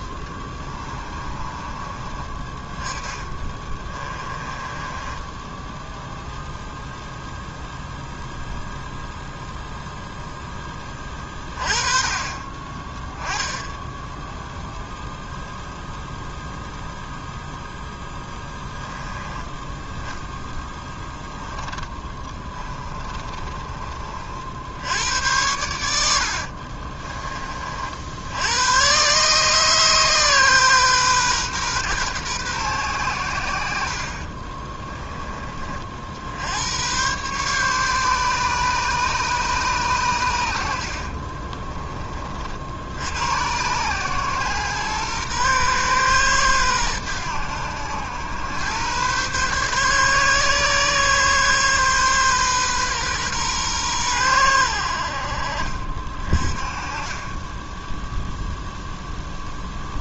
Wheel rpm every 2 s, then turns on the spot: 20, 30, 20, 0, 0, 10, 20, 0, 0, 10, 10, 20, 70, 60, 90, 140, 120, 30, 80, 140, 80, 50, 120, 120, 100, 140, 130, 90, 40, 0.
0-2 4-6 20-24 26-28 34-36